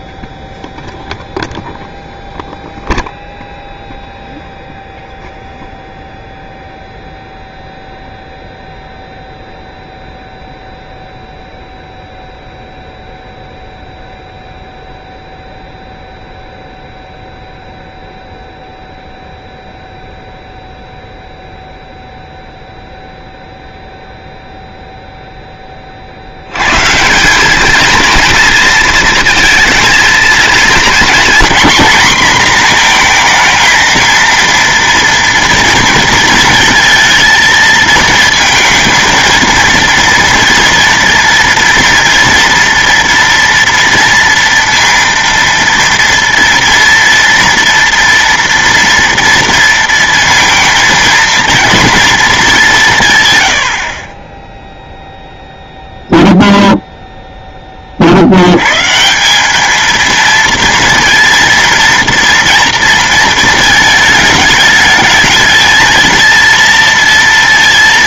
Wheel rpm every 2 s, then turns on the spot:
0, 0, 0, 0, 0, 0, 0, 0, 0, 0, 0, 0, 0, 110, 230, 230, 240, 230, 230, 230, 230, 230, 230, 230, 230, 230, 200, 10, 0, 110, 230, 240, 210, 230.
none